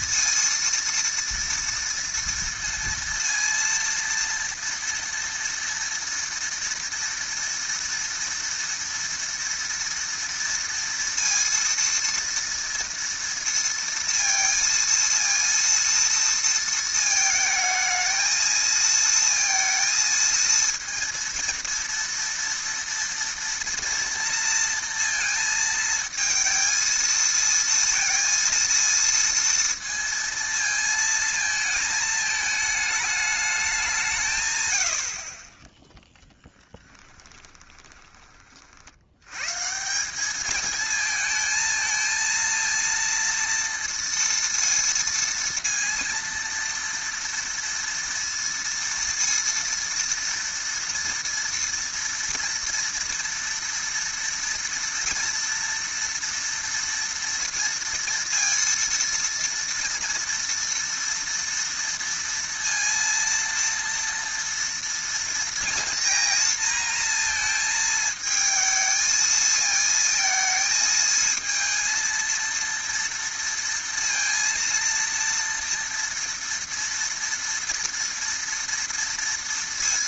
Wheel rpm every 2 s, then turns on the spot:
230, 230, 230, 230, 230, 230, 230, 230, 230, 220, 230, 230, 230, 230, 230, 230, 220, 130, 10, 30, 200, 230, 230, 230, 230, 230, 230, 230, 230, 230, 230, 230, 230, 230, 220, 220, 230, 230, 230, 230.
36-38